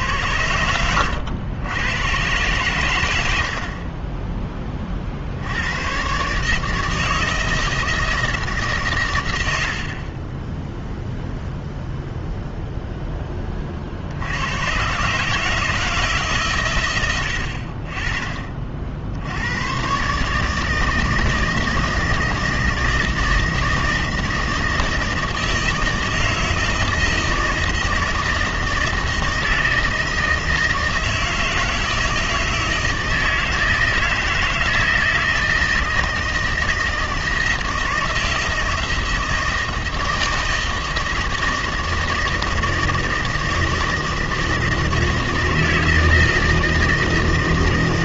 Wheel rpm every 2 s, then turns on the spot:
80, 120, 20, 150, 150, 10, 0, 120, 130, 50, 160, 160, 160, 160, 160, 160, 160, 160, 160, 160, 160, 160, 160, 160.
none